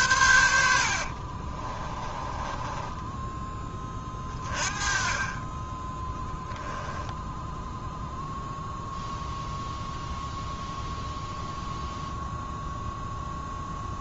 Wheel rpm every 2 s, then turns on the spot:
70, 20, 30, 0, 0, 0, 0.
2-4